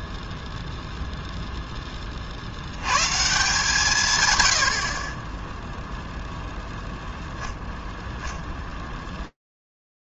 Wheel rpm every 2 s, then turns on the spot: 0, 110, 60, 0, 0.
none